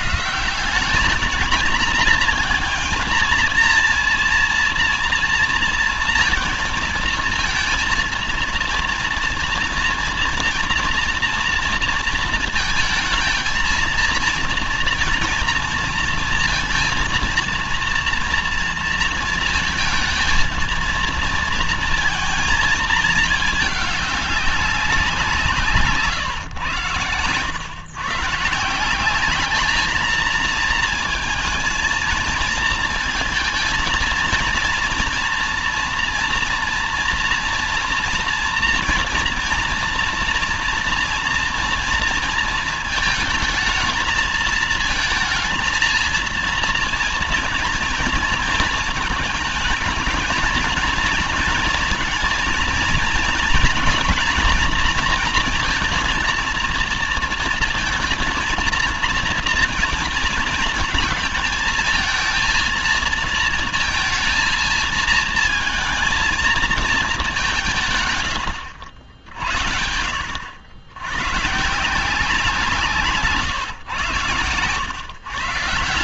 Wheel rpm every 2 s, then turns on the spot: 170, 230, 230, 230, 230, 230, 230, 230, 230, 230, 230, 220, 200, 120, 180, 230, 220, 230, 240, 230, 230, 230, 220, 230, 220, 220, 230, 230, 230, 230, 230, 230, 220, 220, 80, 90, 170, 130.
none